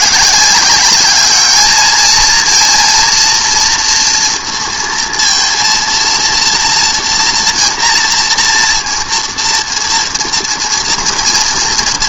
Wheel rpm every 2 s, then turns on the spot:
180, 230, 230, 230, 230, 230.
none